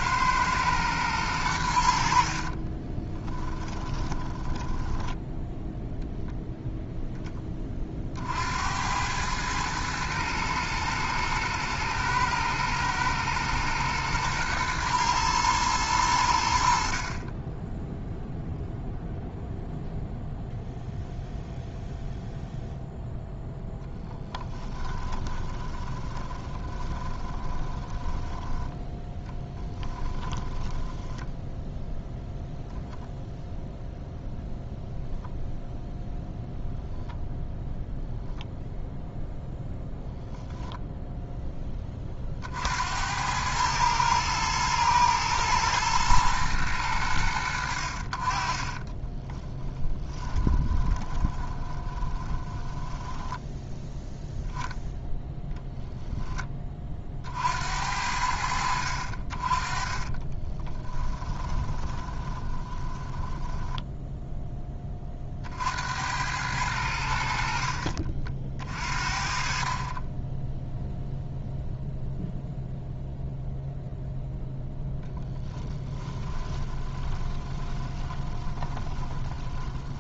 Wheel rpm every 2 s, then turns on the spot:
100, 10, 10, 10, 100, 110, 110, 110, 40, 0, 0, 0, 10, 20, 10, 10, 0, 0, 0, 0, 10, 60, 110, 110, 20, 20, 10, 0, 20, 70, 20, 30, 10, 90, 40, 0, 0, 0, 20, 20.
2-6 24-28 30-32 48-54 60-64 76-80